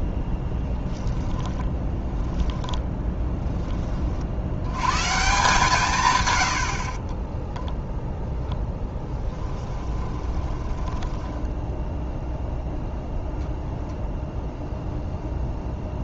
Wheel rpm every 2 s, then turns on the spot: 0, 10, 90, 120, 10, 10, 0, 0.
2-4 6-12